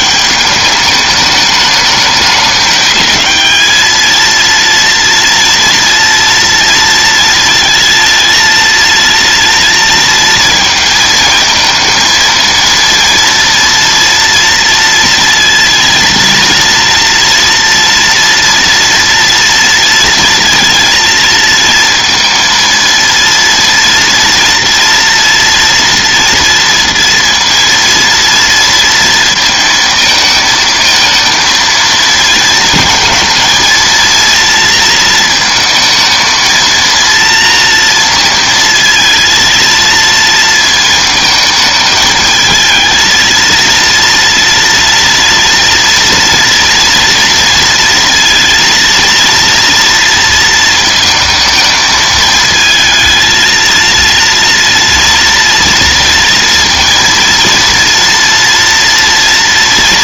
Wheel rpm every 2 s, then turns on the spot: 210, 210, 230, 230, 230, 220, 230, 230, 230, 230, 230, 230, 230, 230, 230, 220, 230, 230, 230, 230, 220, 220, 230, 230, 230, 230, 230, 230, 230, 230.
none